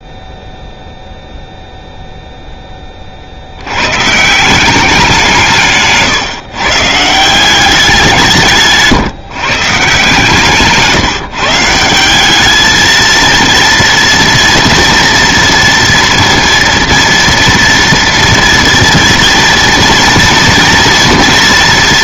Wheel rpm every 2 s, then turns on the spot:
0, 10, 180, 140, 150, 150, 210, 230, 230, 230, 230.
none